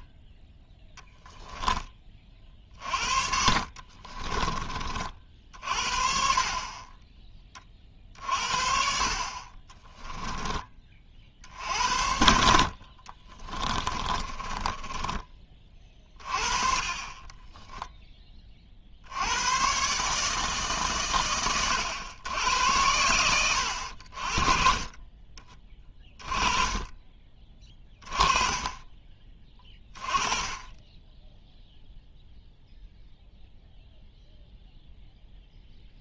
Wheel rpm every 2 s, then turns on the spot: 10, 50, 30, 20, 50, 30, 60, 20, 30, 50, 150, 100, 30, 20, 20, 10, 0, 0.
2-4 12-16